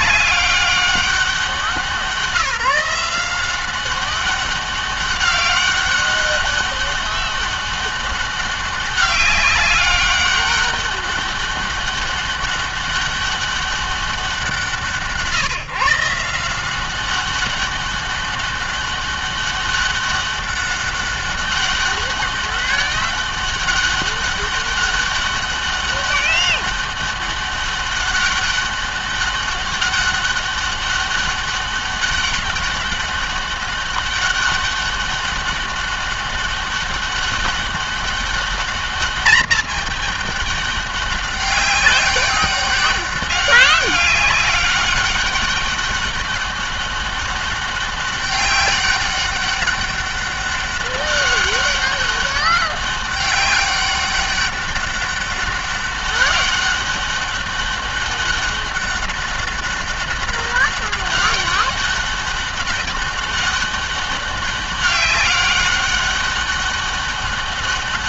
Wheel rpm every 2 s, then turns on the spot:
190, 170, 200, 200, 200, 200, 200, 170, 170, 200, 200, 200, 200, 200, 200, 200, 200, 200, 200, 210, 200, 200, 200, 200, 200, 200, 200, 200, 200, 200, 200, 200, 200, 200.
none